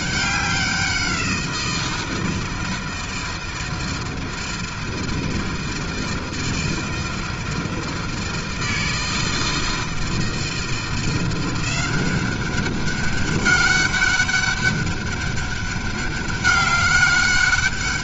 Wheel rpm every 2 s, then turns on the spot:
190, 160, 160, 160, 160, 160, 190, 200, 200.
none